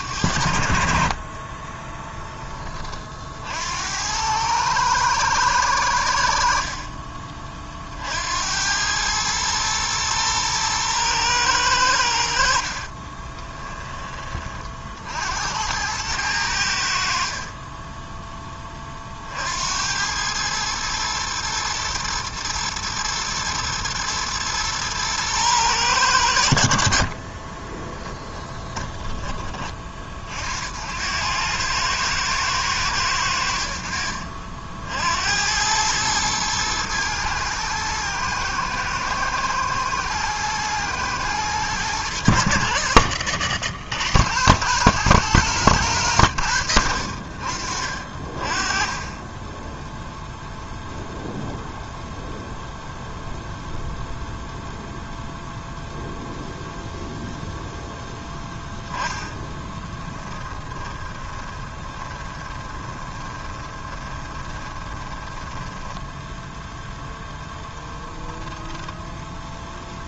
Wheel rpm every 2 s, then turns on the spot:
60, 20, 110, 60, 80, 110, 60, 30, 90, 10, 110, 120, 110, 80, 10, 50, 110, 60, 110, 110, 110, 110, 110, 90, 30, 0, 0, 0, 0, 10, 10, 20, 20, 10, 10.
6-8 12-14 28-30 60-66 68-70